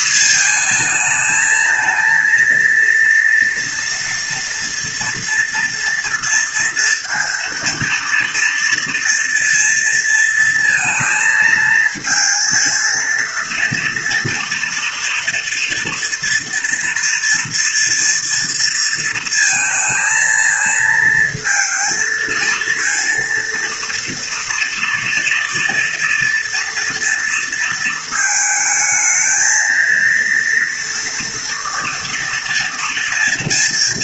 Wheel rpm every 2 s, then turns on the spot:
220, 230, 230, 230, 230, 220, 230, 230, 240, 230, 230, 230, 230, 230, 220, 230, 230.
none